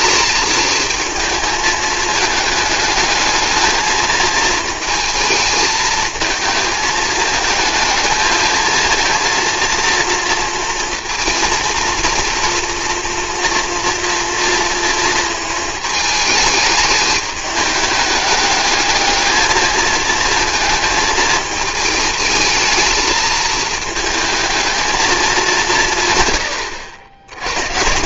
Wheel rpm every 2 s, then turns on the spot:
220, 220, 220, 220, 220, 230, 230, 230, 210, 210, 220, 220, 220, 100.
none